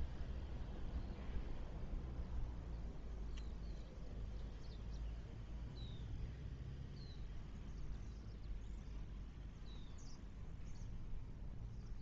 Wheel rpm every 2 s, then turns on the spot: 0, 0, 0, 0, 0, 0.
none